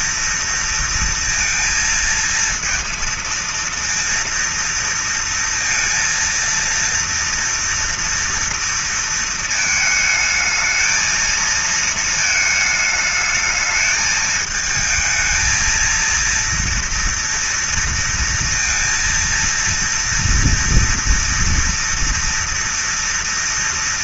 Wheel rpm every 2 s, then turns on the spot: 230, 230, 230, 230, 230, 220, 220, 220, 230, 230, 230, 230.
none